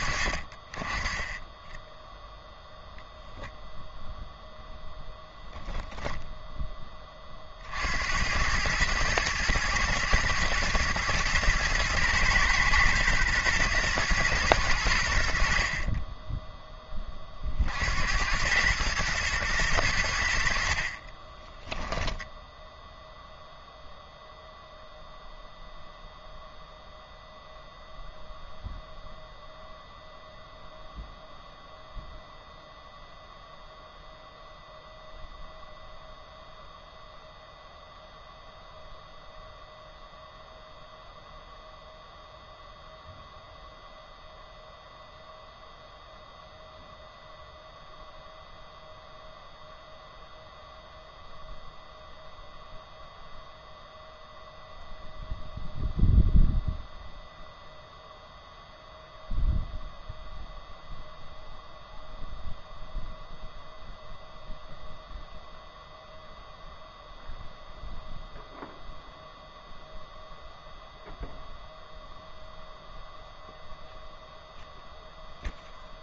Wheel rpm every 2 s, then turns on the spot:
30, 0, 0, 10, 100, 120, 120, 100, 10, 100, 60, 0, 0, 0, 0, 0, 0, 0, 0, 0, 0, 0, 0, 0, 0, 0, 0, 0, 0, 0, 0, 0, 0, 0, 0, 0, 0, 0.
none